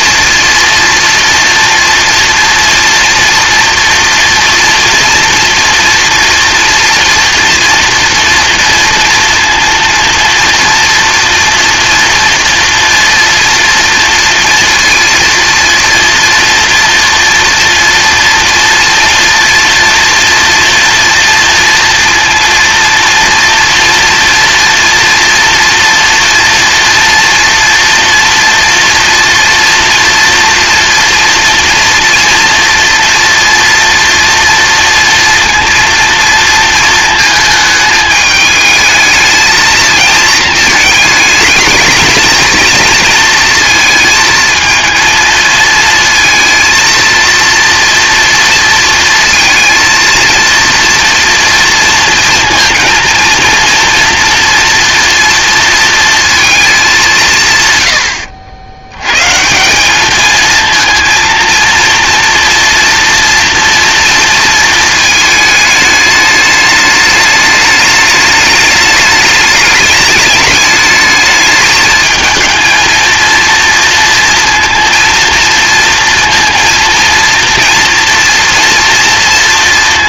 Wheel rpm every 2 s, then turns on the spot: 230, 230, 230, 230, 230, 230, 230, 230, 230, 230, 230, 230, 240, 230, 230, 230, 230, 230, 220, 220, 220, 230, 220, 230, 230, 230, 230, 230, 210, 90, 230, 230, 230, 210, 210, 210, 220, 230, 230, 230.
none